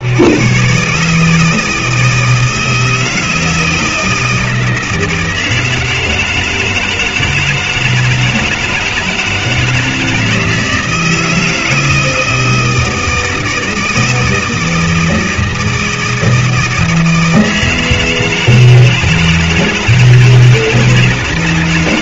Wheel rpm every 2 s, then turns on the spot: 120, 160, 160, 160, 160, 160, 160, 160, 160, 160, 160.
none